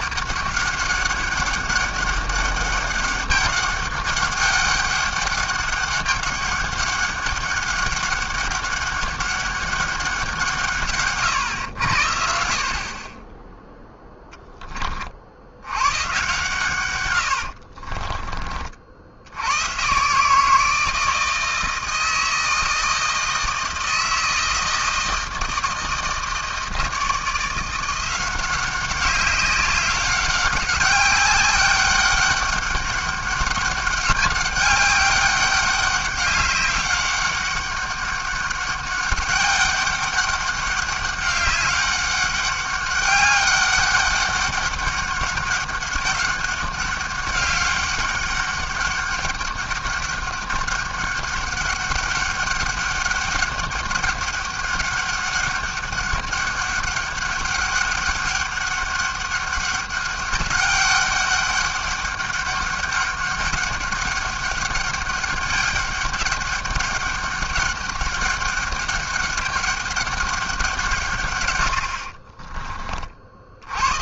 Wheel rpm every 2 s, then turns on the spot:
190, 200, 200, 200, 200, 160, 60, 20, 130, 40, 160, 160, 160, 160, 180, 200, 200, 200, 200, 200, 200, 200, 200, 200, 200, 200, 200, 200, 200, 200, 200, 200, 200, 200, 200, 180, 30.
none